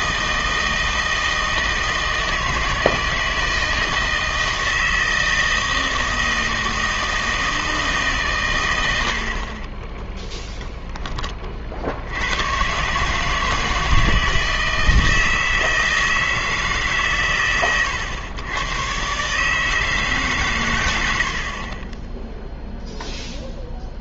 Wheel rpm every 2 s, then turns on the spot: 160, 160, 160, 160, 110, 10, 130, 160, 160, 110, 120, 0.
none